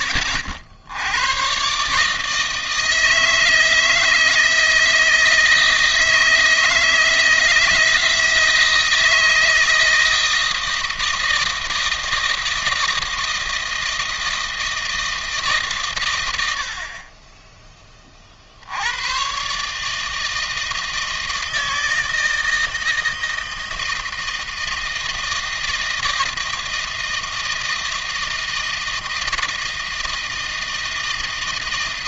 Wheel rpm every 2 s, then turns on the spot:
70, 160, 160, 160, 160, 160, 160, 160, 80, 70, 160, 160, 160, 160, 160, 160.
none